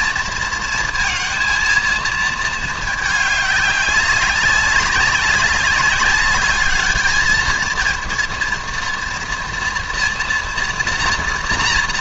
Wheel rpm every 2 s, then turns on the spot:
230, 220, 200, 200, 230, 240.
none